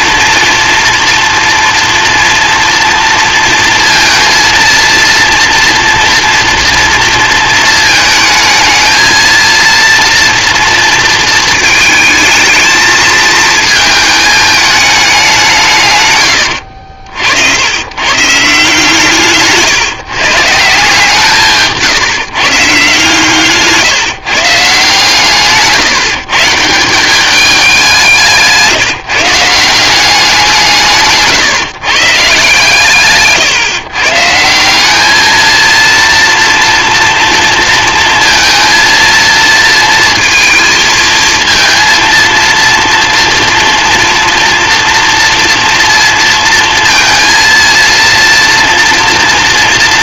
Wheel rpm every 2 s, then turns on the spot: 230, 230, 230, 230, 220, 230, 220, 210, 60, 150, 160, 140, 140, 170, 170, 150, 140, 200, 230, 230, 230, 230, 230, 230, 230.
none